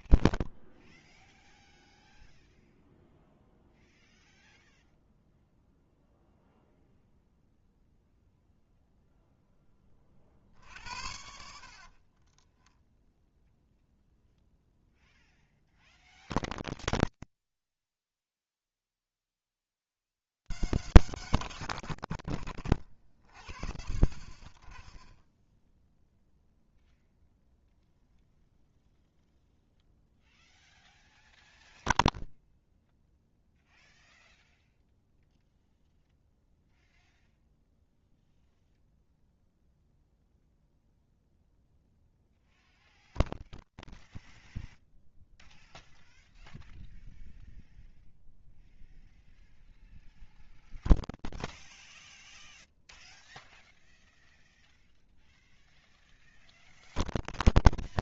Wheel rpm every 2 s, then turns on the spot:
0, 0, 0, 0, 0, 70, 10, 0, 0, 10, 160, 120, 30, 0, 0, 0, 0, 0, 0, 0, 0, 0, 0, 0, 0, 0, 0, 0, 0.
12-14